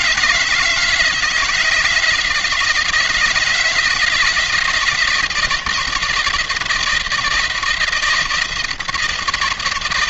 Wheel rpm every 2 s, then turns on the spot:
160, 160, 170, 170, 160.
none